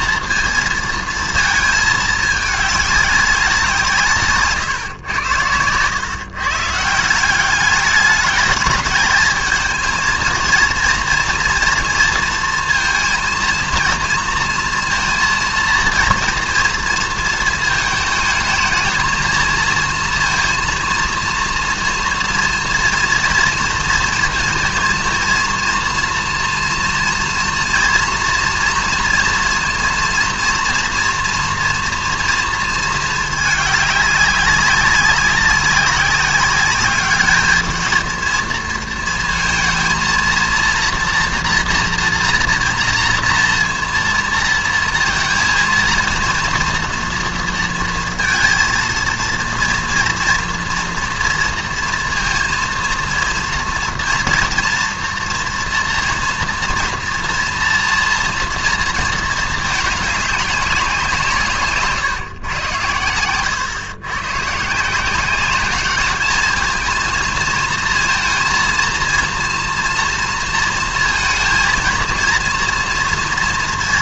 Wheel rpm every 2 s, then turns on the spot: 230, 210, 140, 150, 210, 230, 230, 230, 230, 220, 230, 230, 230, 230, 230, 230, 230, 200, 200, 230, 230, 230, 230, 240, 230, 230, 230, 230, 230, 230, 200, 120, 140, 220, 230, 230, 230.
none